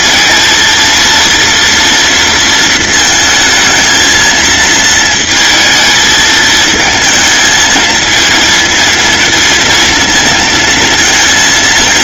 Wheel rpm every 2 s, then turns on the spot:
230, 230, 220, 220, 230, 230.
none